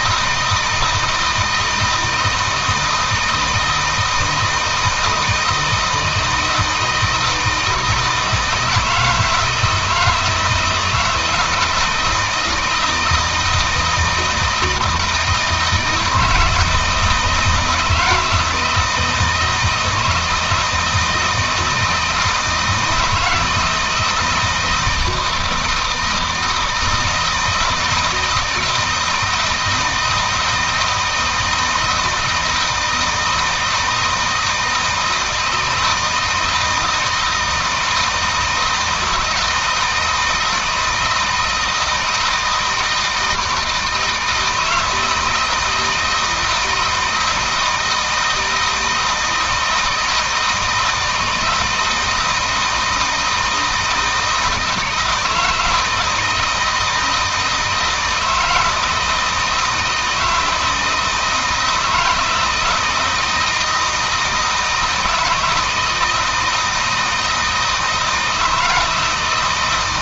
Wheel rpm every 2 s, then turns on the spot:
160, 160, 160, 160, 160, 160, 160, 160, 160, 160, 160, 160, 170, 160, 170, 160, 160, 160, 160, 160, 160, 160, 160, 160, 160, 160, 160, 160, 160, 160, 160, 170, 160, 160, 160.
none